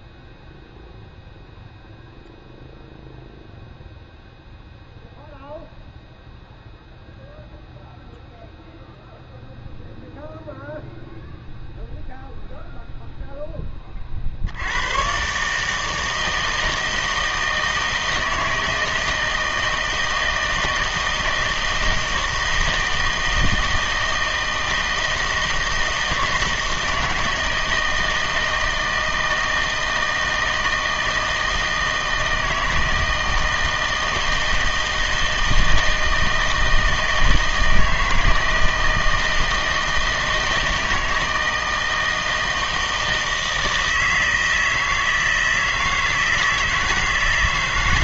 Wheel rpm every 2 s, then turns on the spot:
0, 0, 0, 0, 0, 0, 0, 90, 160, 160, 160, 160, 160, 160, 160, 160, 160, 160, 160, 160, 160, 160, 160, 160.
none